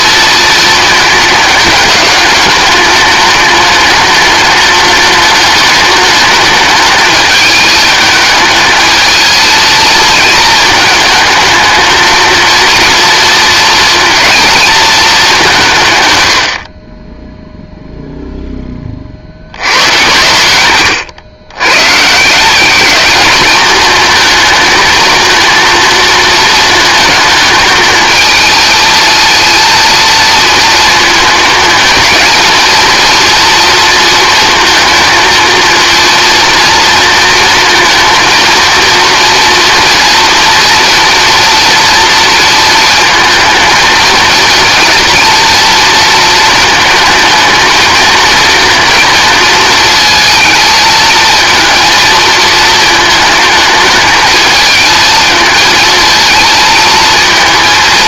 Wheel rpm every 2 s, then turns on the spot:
230, 210, 210, 210, 220, 220, 230, 230, 50, 20, 100, 190, 220, 220, 230, 230, 220, 230, 230, 230, 230, 230, 230, 220, 230, 220, 220, 220, 220.
none